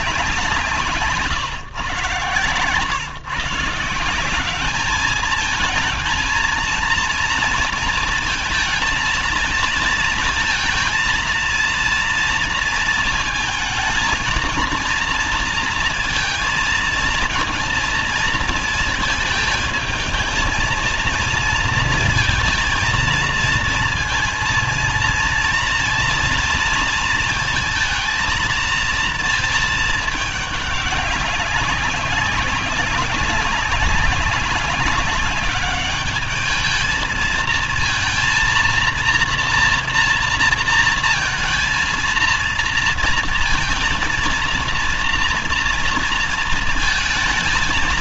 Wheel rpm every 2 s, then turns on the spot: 150, 120, 200, 220, 230, 220, 230, 230, 230, 220, 220, 220, 230, 230, 230, 200, 190, 200, 210, 230, 230, 230, 230, 230.
none